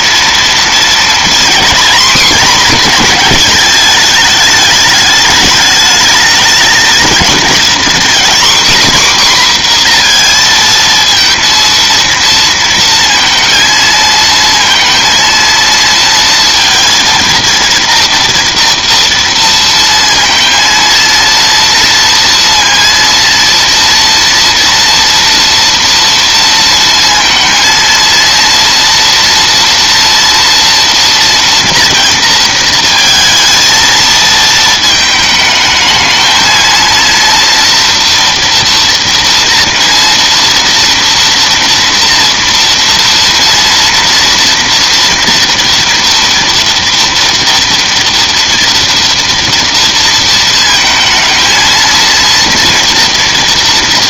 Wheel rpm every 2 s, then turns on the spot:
240, 210, 210, 240, 250, 230, 230, 230, 230, 230, 230, 230, 230, 230, 240, 230, 220, 220, 230, 230, 230, 230, 230, 230, 230, 230, 230.
none